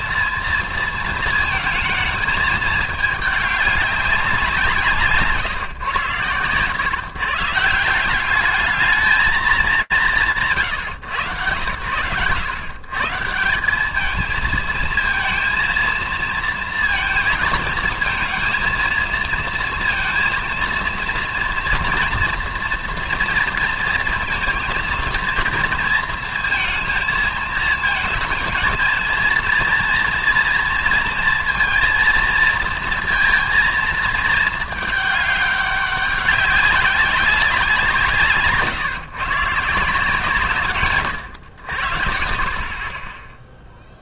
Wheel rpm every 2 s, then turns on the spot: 230, 220, 150, 130, 210, 100, 150, 230, 230, 230, 240, 230, 230, 220, 230, 230, 230, 210, 200, 140, 120, 10.
none